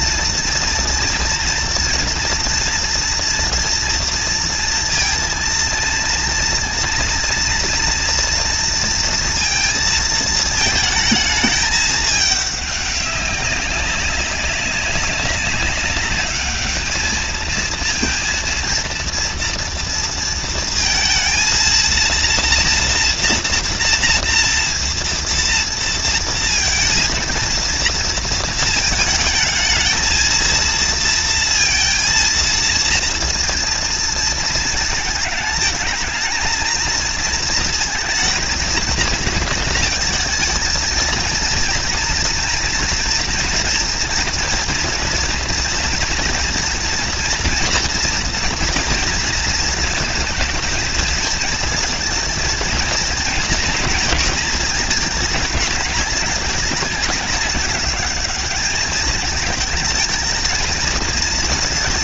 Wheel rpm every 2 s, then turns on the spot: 230, 230, 230, 230, 240, 220, 200, 190, 210, 230, 230, 240, 240, 230, 220, 230, 230, 230, 230, 220, 220, 240, 230, 230, 230, 220, 230, 220, 210, 210, 220.
none